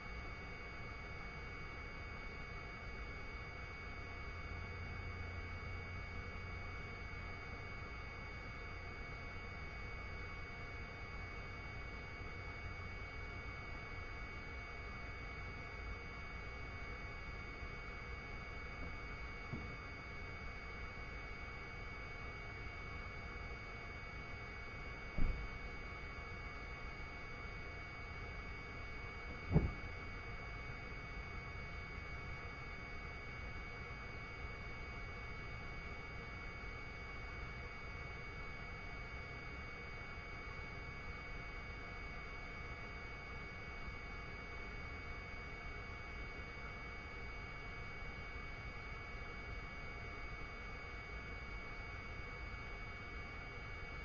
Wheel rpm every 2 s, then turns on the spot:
0, 0, 0, 0, 0, 0, 0, 0, 0, 0, 0, 0, 0, 0, 0, 0, 0, 0, 0, 0, 0, 0, 0, 0, 0, 0, 0.
none